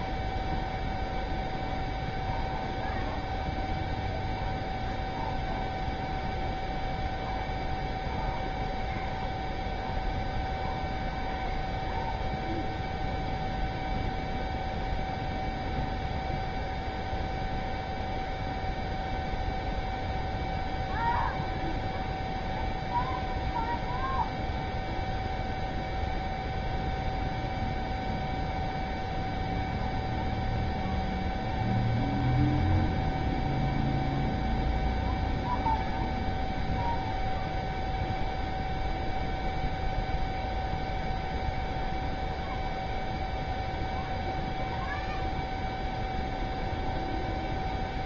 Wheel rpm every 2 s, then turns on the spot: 0, 0, 0, 0, 0, 0, 0, 0, 0, 0, 0, 0, 0, 0, 0, 0, 0, 0, 0, 0, 0, 0, 0, 0.
none